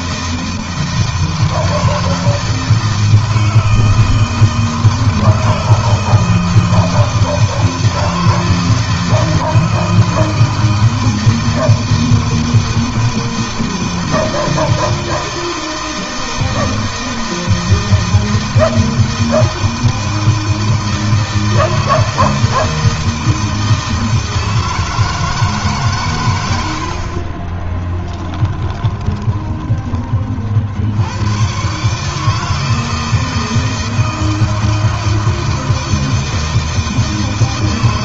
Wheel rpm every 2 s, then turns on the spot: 160, 160, 160, 160, 160, 160, 160, 160, 160, 160, 160, 160, 160, 100, 10, 40, 150, 160, 160.
26-30